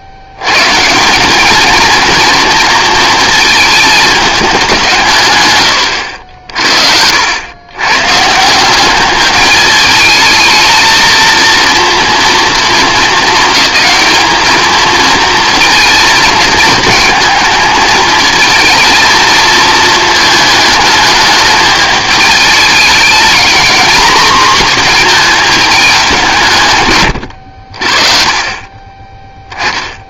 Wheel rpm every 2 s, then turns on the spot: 90, 230, 190, 60, 190, 220, 220, 220, 220, 220, 220, 210, 240, 140, 20.
none